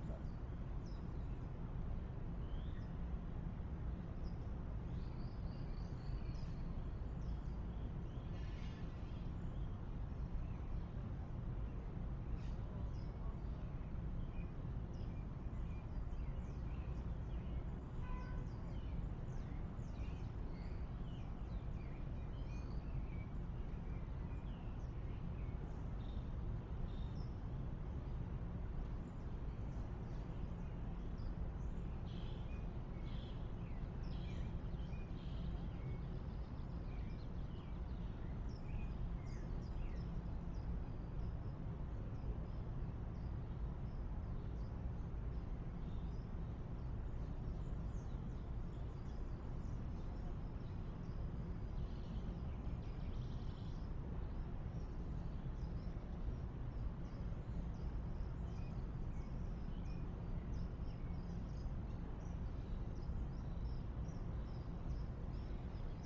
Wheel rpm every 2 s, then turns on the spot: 0, 0, 0, 0, 0, 0, 0, 0, 0, 0, 0, 0, 0, 0, 0, 0, 0, 0, 0, 0, 0, 0, 0, 0, 0, 0, 0, 0, 0, 0, 0, 0, 0.
none